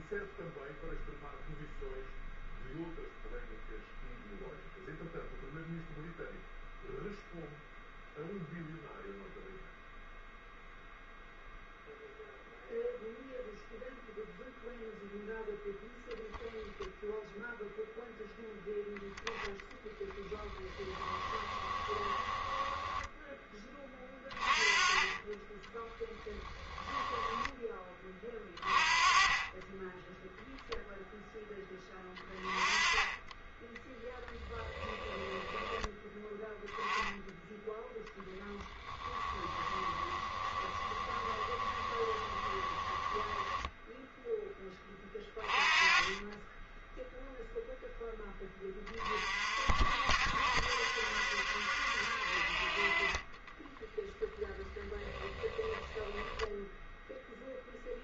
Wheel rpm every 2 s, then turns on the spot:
0, 0, 0, 0, 0, 0, 0, 0, 0, 0, 10, 10, 30, 10, 30, 0, 20, 20, 10, 10, 20, 20, 20, 10, 20, 60, 40, 10, 0.
20-24 26-28 34-36 38-44 54-56